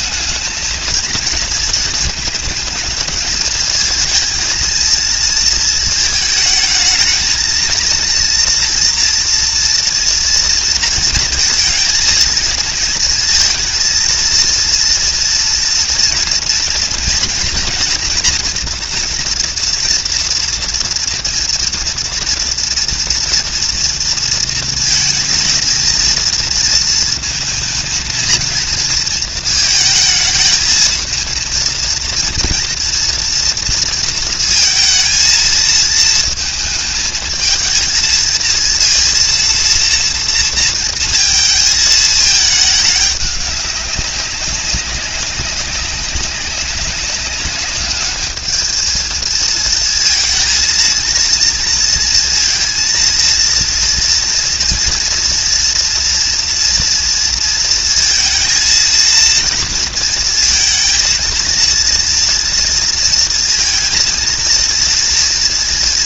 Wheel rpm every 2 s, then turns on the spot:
220, 220, 230, 220, 230, 230, 230, 230, 230, 240, 230, 230, 230, 230, 230, 220, 230, 220, 220, 230, 230, 210, 190, 200, 220, 230, 230, 230, 230, 220, 230, 230, 230.
none